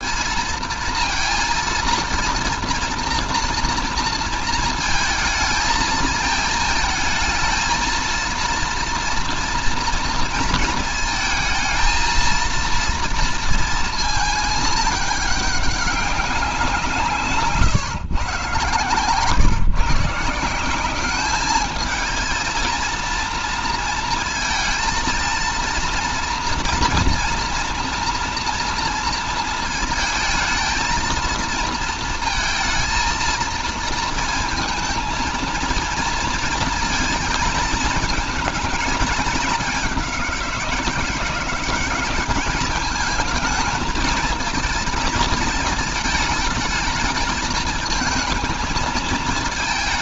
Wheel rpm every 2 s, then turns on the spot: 230, 230, 220, 220, 230, 220, 230, 210, 180, 130, 190, 230, 230, 230, 230, 230, 230, 230, 230, 220, 180, 210, 220, 220, 220.
none